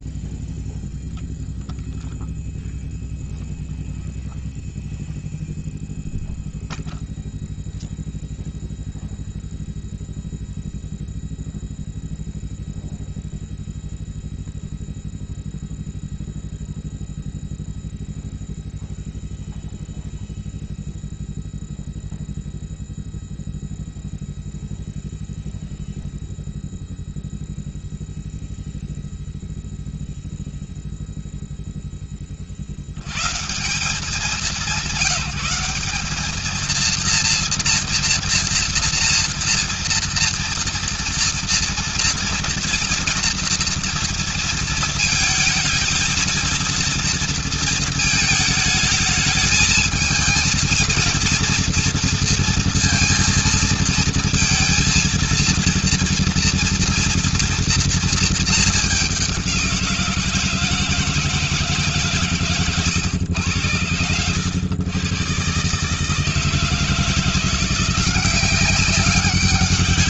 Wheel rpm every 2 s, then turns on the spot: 0, 0, 0, 0, 0, 0, 0, 0, 0, 0, 0, 0, 0, 0, 0, 10, 170, 200, 230, 230, 230, 230, 220, 230, 220, 230, 230, 230, 230, 180, 150, 100, 130, 170, 200.
none